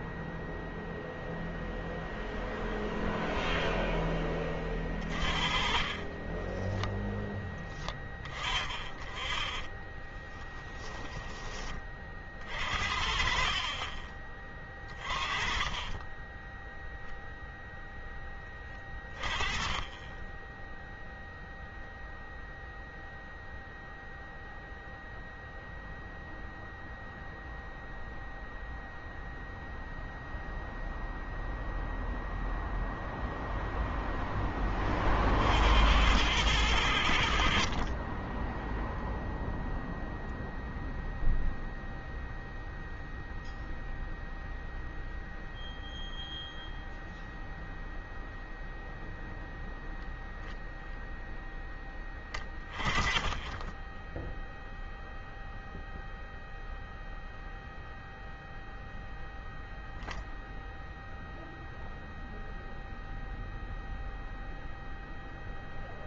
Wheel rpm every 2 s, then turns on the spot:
0, 0, 20, 10, 20, 10, 40, 20, 0, 20, 10, 0, 0, 0, 0, 0, 0, 20, 90, 10, 0, 0, 0, 0, 0, 0, 10, 0, 0, 0, 0, 0, 0.
4-6 8-10 14-16